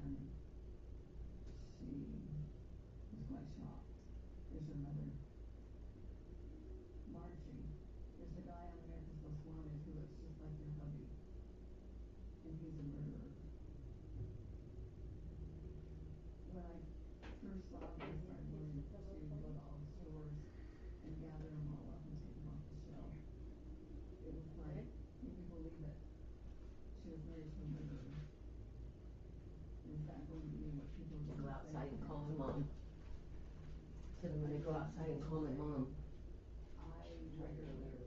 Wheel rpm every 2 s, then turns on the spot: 0, 0, 0, 0, 0, 0, 0, 0, 0, 0, 0, 0, 0, 0, 0, 0, 0, 0, 0.
none